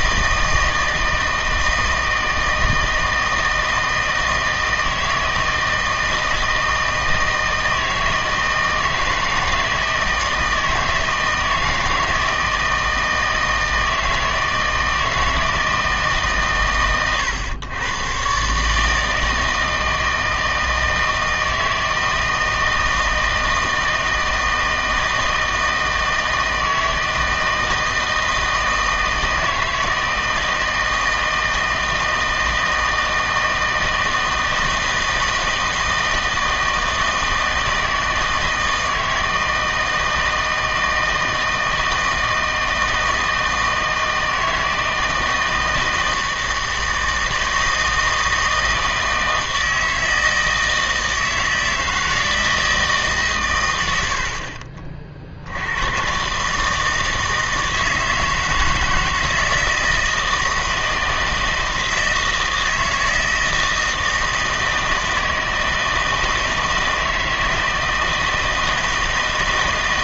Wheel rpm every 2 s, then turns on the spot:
160, 160, 160, 160, 160, 160, 160, 160, 120, 150, 160, 160, 160, 160, 160, 160, 160, 160, 160, 160, 160, 160, 160, 160, 160, 160, 160, 50, 150, 160, 160, 160, 160, 160, 160.
54-56